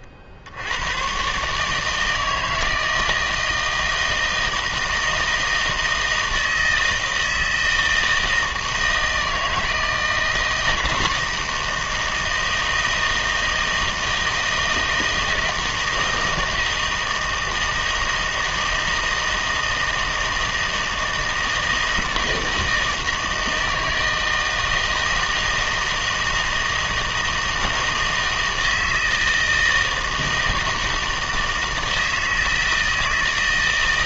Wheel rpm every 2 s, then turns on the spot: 80, 160, 160, 160, 160, 160, 160, 160, 160, 160, 160, 160, 160, 160, 160, 160, 160.
none